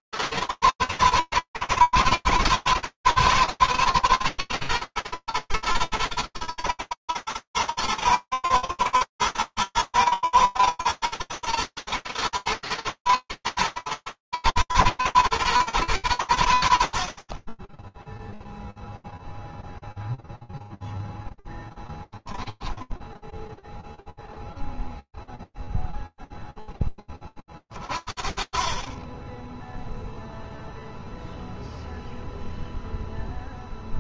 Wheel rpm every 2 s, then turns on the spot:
110, 110, 110, 110, 110, 110, 120, 110, 100, 10, 0, 0, 0, 10, 30, 0, 0.
none